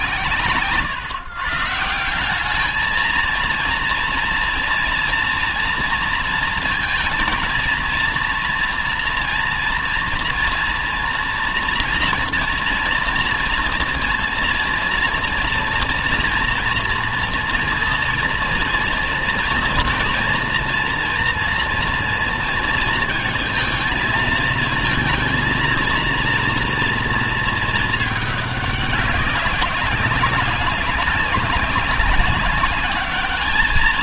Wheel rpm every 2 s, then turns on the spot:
140, 200, 230, 230, 240, 230, 230, 230, 240, 230, 230, 230, 220, 230, 210, 190, 200.
none